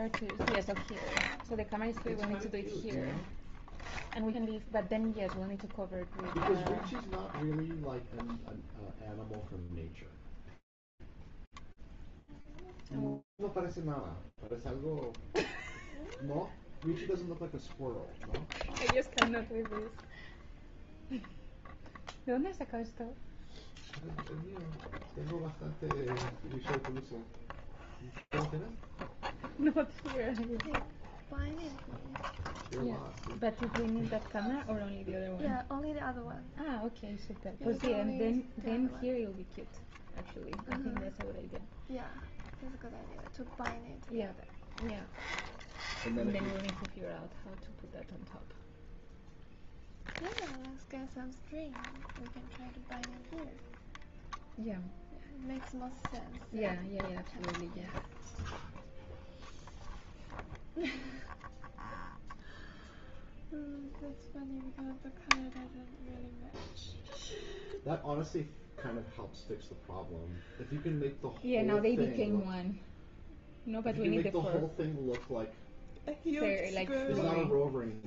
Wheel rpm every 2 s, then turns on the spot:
0, 0, 0, 0, 0, 0, 0, 0, 0, 0, 0, 0, 0, 0, 0, 0, 0, 0, 0, 0, 0, 0, 0, 0, 0, 0, 0, 0, 0, 0, 0, 0, 0, 0, 0, 0, 0, 0, 0.
none